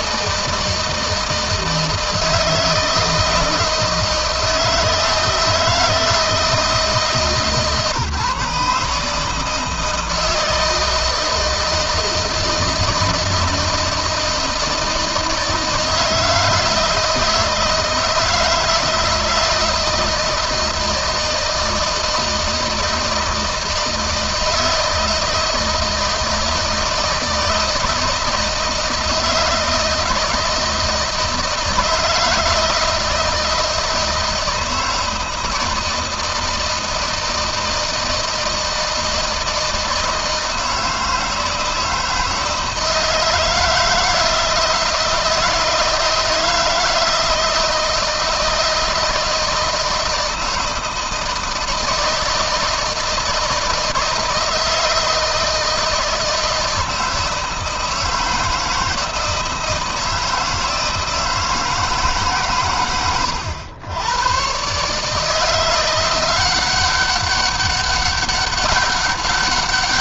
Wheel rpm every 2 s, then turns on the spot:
160, 160, 160, 150, 150, 160, 160, 160, 160, 160, 160, 160, 160, 160, 170, 160, 160, 160, 160, 160, 160, 160, 160, 160, 160, 160, 160, 160, 160, 160, 160, 100, 150, 190, 200.
none